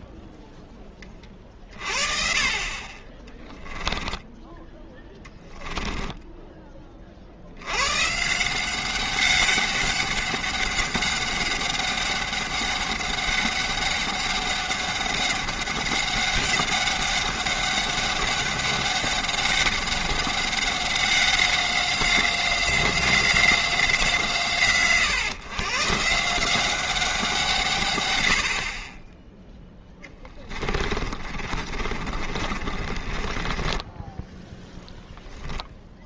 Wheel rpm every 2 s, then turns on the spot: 10, 40, 10, 20, 180, 200, 200, 200, 200, 200, 190, 190, 140, 180, 50, 30, 40, 0.
4-6 30-34